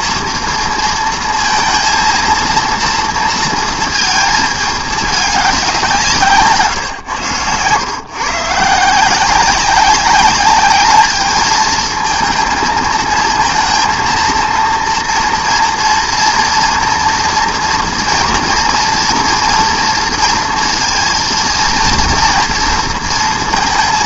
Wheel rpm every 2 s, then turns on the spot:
230, 230, 210, 150, 150, 200, 230, 230, 230, 240, 230, 230.
6-8